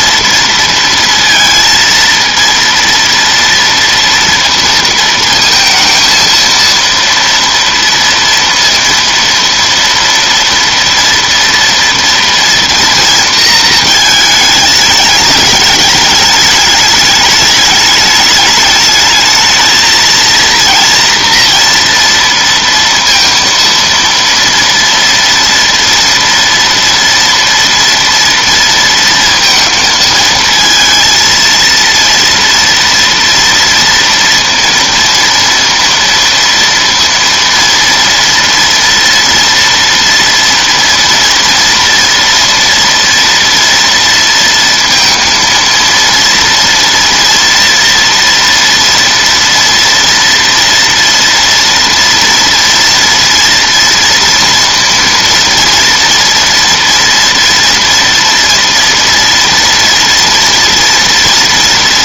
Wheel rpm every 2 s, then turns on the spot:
230, 230, 230, 230, 230, 230, 230, 210, 210, 210, 230, 230, 230, 230, 230, 230, 230, 230, 230, 240, 230, 230, 230, 230, 230, 230, 230, 230, 230, 230, 230.
none